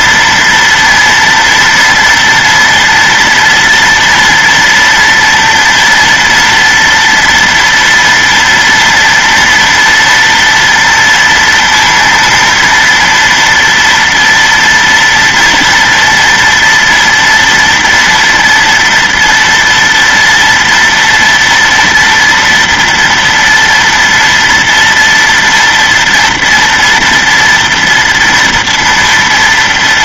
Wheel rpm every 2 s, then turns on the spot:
230, 230, 230, 230, 240, 230, 230, 230, 230, 230, 230, 230, 230, 230, 230.
none